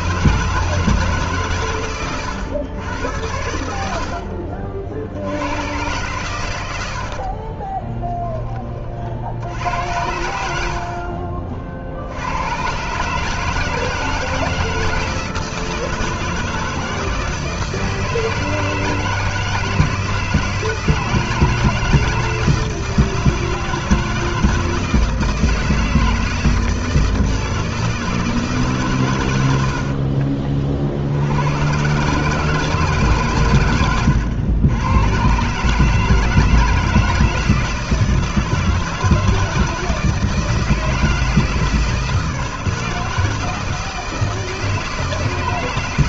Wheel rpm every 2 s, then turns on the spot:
160, 100, 50, 90, 20, 70, 110, 160, 170, 160, 160, 160, 160, 160, 150, 50, 160, 100, 160, 160, 160, 160, 160.
none